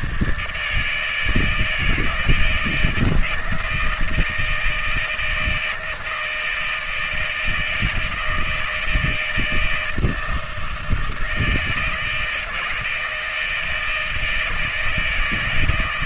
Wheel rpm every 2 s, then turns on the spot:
80, 160, 160, 160, 160, 160, 160, 160.
none